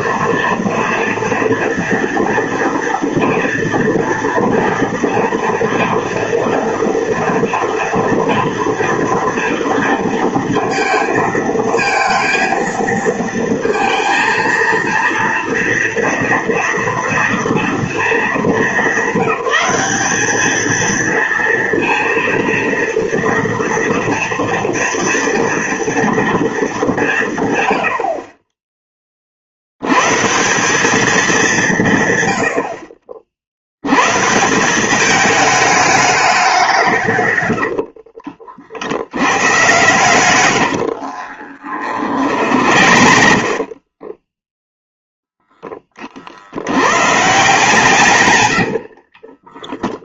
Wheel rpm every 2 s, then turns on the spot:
240, 240, 230, 230, 230, 230, 230, 230, 230, 210, 220, 230, 230, 210, 20, 180, 80, 160, 190, 50, 110, 50, 10, 80, 90.
40-44 48-50